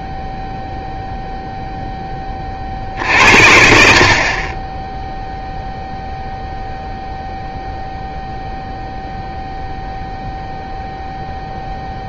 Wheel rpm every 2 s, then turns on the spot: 0, 40, 30, 0, 0, 0.
none